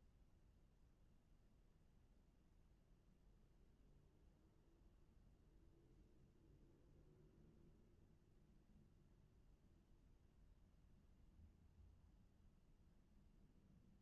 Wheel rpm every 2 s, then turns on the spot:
0, 0, 0, 0, 0, 0, 0.
none